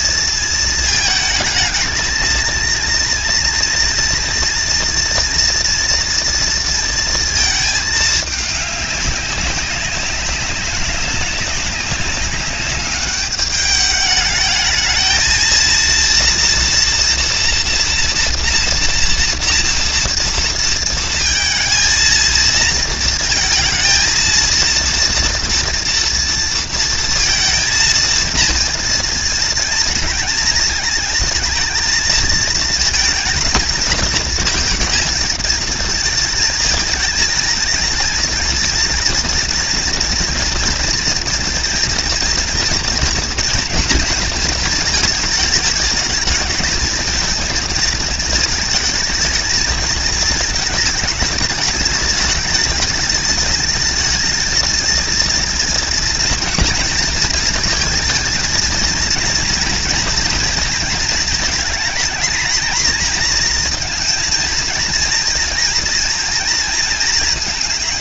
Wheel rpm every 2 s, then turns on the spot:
220, 230, 230, 230, 210, 190, 200, 210, 240, 230, 230, 230, 230, 230, 230, 230, 230, 220, 220, 230, 230, 230, 220, 220, 220, 220, 220, 220, 230, 230, 230, 220, 230, 220.
none